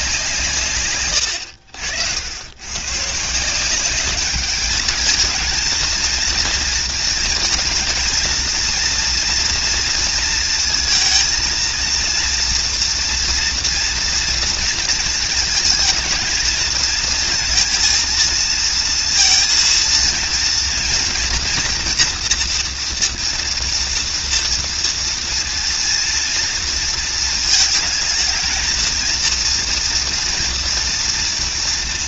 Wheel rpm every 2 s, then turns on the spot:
150, 100, 210, 230, 230, 230, 230, 230, 230, 230, 230, 240, 230, 230, 220, 230.
none